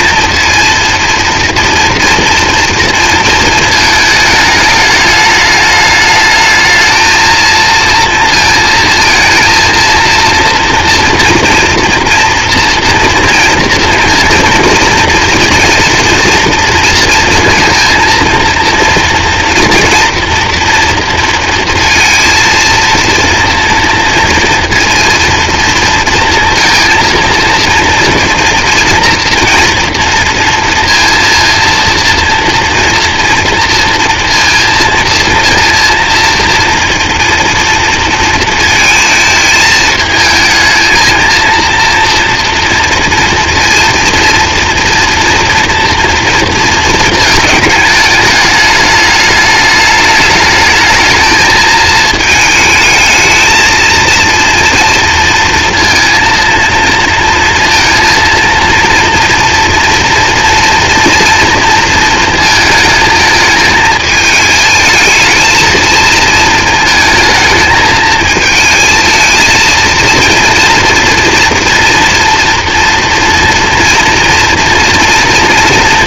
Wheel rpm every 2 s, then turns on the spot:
230, 230, 210, 220, 230, 230, 230, 230, 230, 230, 230, 230, 230, 230, 240, 230, 230, 230, 230, 230, 220, 230, 230, 230, 210, 210, 220, 230, 230, 230, 230, 220, 220, 220, 220, 230, 240, 230.
none